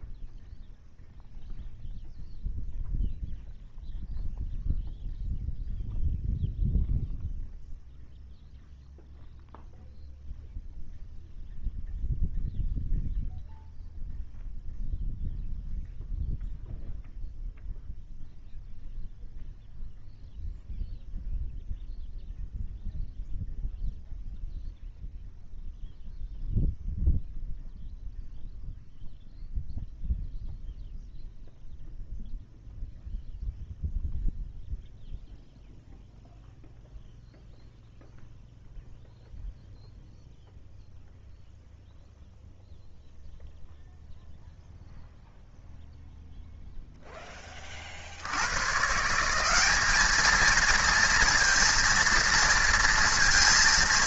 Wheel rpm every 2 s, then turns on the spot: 0, 0, 0, 0, 0, 0, 0, 0, 0, 0, 0, 0, 0, 0, 0, 0, 0, 0, 0, 0, 0, 0, 0, 0, 170, 230, 230.
none